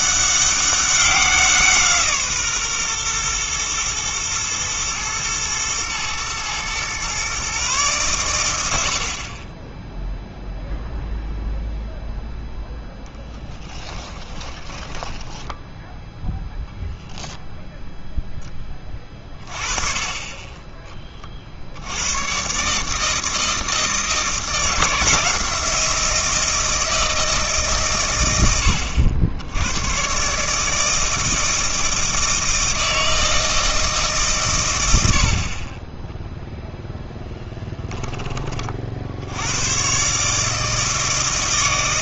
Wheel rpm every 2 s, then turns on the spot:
200, 130, 110, 120, 60, 0, 0, 10, 0, 20, 20, 140, 170, 160, 80, 160, 160, 90, 0, 40, 160.
14-16